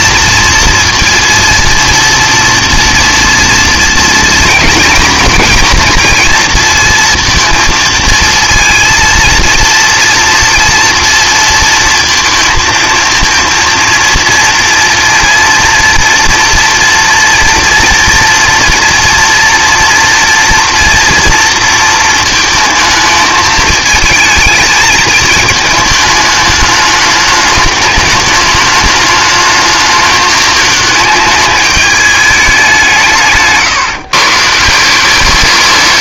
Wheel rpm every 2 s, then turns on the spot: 230, 230, 230, 230, 220, 230, 230, 230, 230, 230, 230, 220, 220, 210, 210, 210, 190, 170.
none